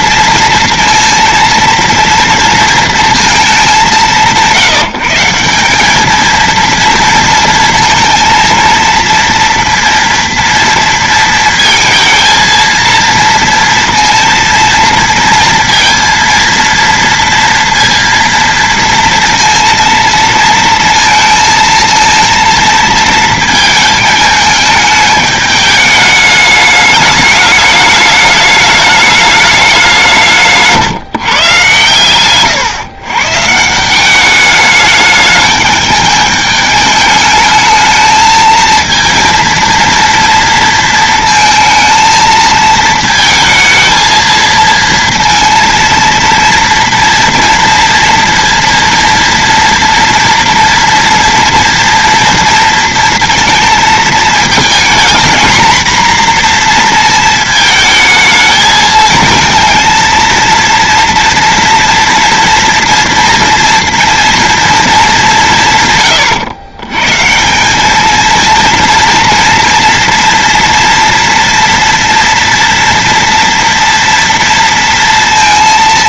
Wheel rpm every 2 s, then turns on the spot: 230, 230, 190, 220, 230, 230, 230, 230, 230, 230, 230, 230, 220, 210, 210, 180, 110, 190, 210, 220, 230, 230, 220, 230, 230, 240, 230, 220, 240, 220, 230, 240, 230, 130, 220, 230, 230, 230.
none